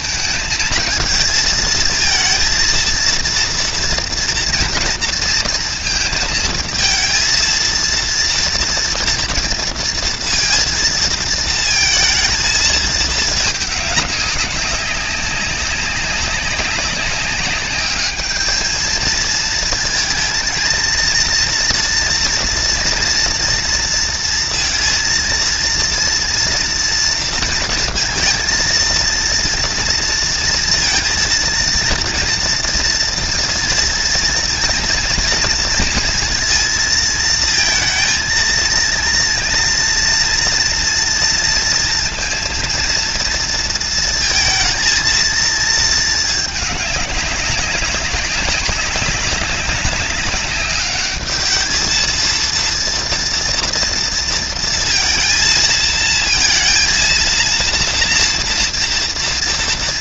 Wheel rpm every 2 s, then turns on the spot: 220, 230, 230, 230, 230, 230, 220, 190, 190, 220, 220, 230, 230, 230, 230, 230, 230, 240, 230, 230, 240, 230, 230, 200, 200, 210, 230, 230, 230, 230.
none